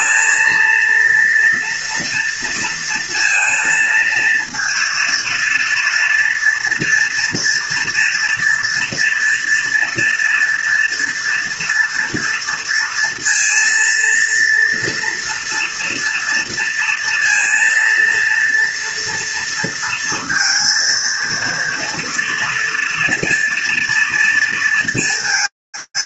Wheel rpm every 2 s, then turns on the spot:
230, 230, 230, 230, 230, 230, 230, 230, 230, 230, 230, 240, 230.
none